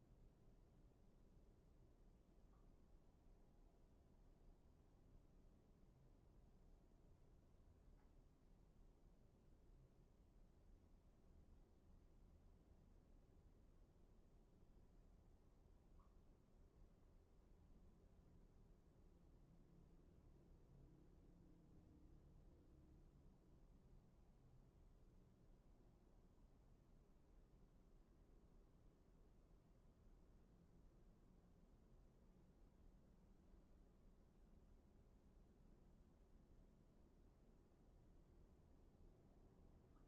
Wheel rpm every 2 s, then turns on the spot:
0, 0, 0, 0, 0, 0, 0, 0, 0, 0, 0, 0, 0, 0, 0, 0, 0, 0, 0, 0.
none